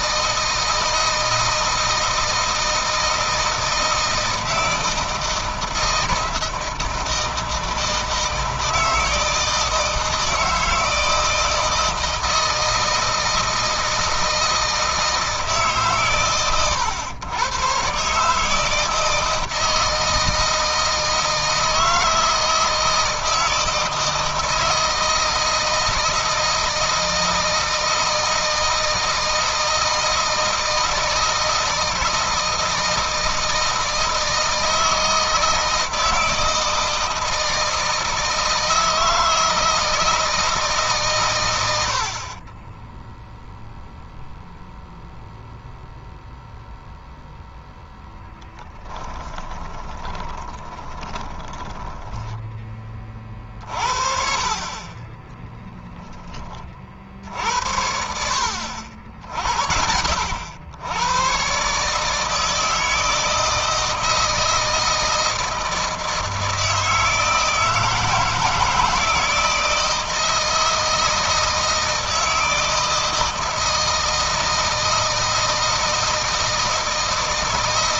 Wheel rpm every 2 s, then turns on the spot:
160, 160, 160, 160, 160, 160, 160, 160, 110, 160, 160, 160, 160, 160, 160, 160, 160, 160, 160, 160, 140, 10, 0, 0, 10, 20, 20, 30, 60, 70, 110, 160, 160, 160, 160, 160, 160, 160, 160.
42-44 48-52